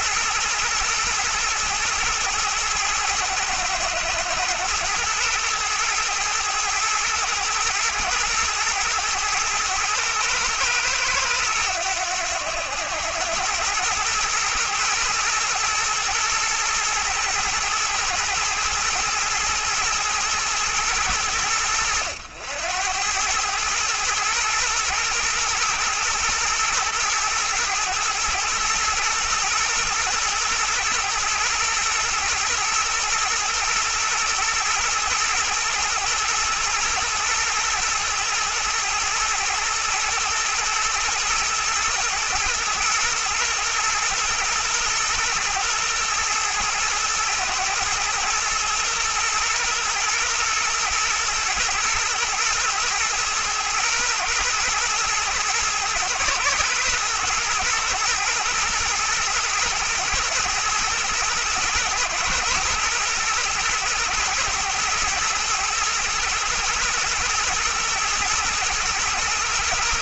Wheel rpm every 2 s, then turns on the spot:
120, 110, 110, 110, 110, 110, 100, 120, 120, 110, 110, 90, 120, 120, 110, 120, 120, 110, 110, 110, 110, 120, 120, 120, 120, 110, 120, 110, 110, 110, 120, 120, 110, 110, 110.
none